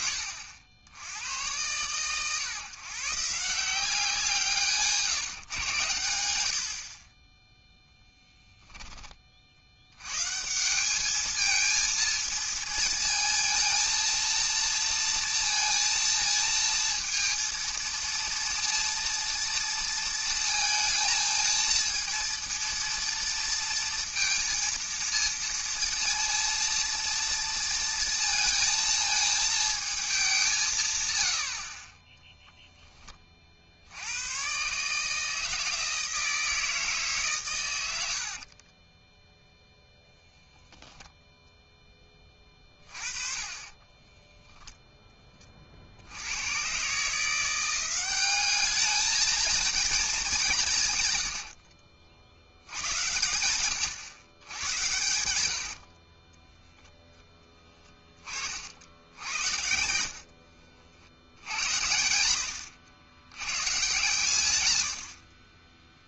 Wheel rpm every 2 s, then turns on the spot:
70, 130, 170, 70, 10, 160, 230, 230, 230, 230, 230, 230, 230, 230, 230, 180, 0, 130, 160, 40, 0, 30, 0, 100, 200, 180, 80, 110, 10, 50, 60, 90, 120.
8-10 38-40 56-58 60-62